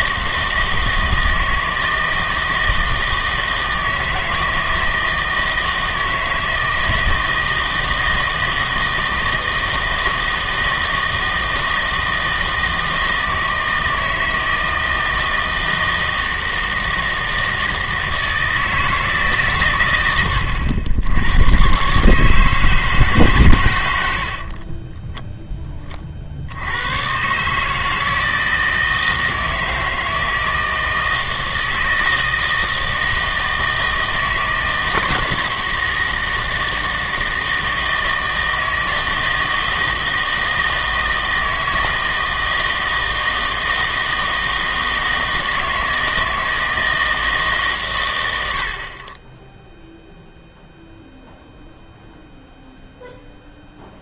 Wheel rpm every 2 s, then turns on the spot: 160, 160, 160, 160, 160, 160, 160, 160, 160, 160, 90, 160, 40, 80, 160, 160, 160, 160, 160, 160, 160, 160, 160, 160, 60, 0, 0.
24-26